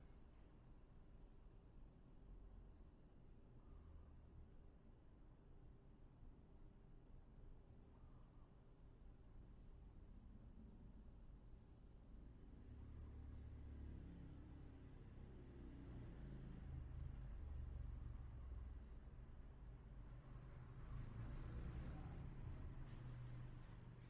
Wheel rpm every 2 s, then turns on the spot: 0, 0, 0, 0, 0, 0, 0, 0, 0, 0, 0, 0.
none